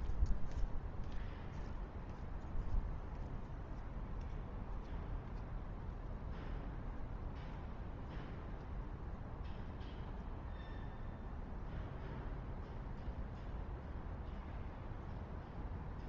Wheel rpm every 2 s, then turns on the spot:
0, 0, 0, 0, 0, 0, 0, 0.
none